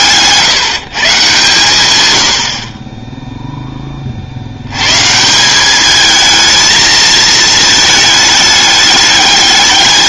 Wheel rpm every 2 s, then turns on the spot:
150, 40, 110, 220, 210.
none